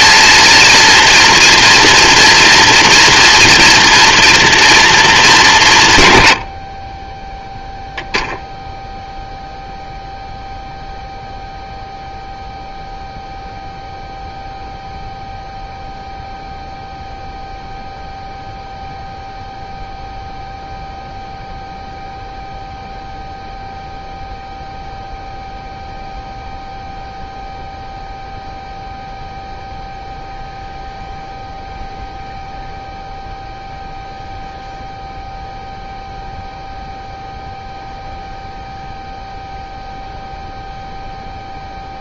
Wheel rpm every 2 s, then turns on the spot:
230, 230, 210, 20, 0, 0, 0, 0, 0, 0, 0, 0, 0, 0, 0, 0, 0, 0, 0, 0, 0.
none